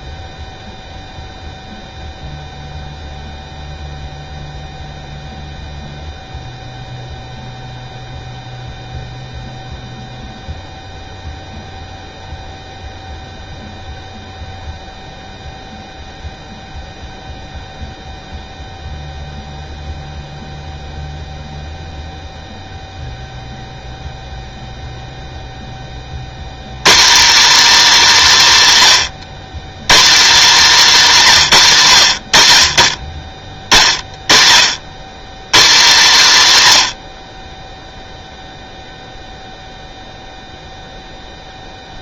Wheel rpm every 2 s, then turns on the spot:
0, 0, 0, 0, 0, 0, 0, 0, 0, 0, 0, 0, 0, 120, 190, 230, 60, 90, 140, 0, 0.
none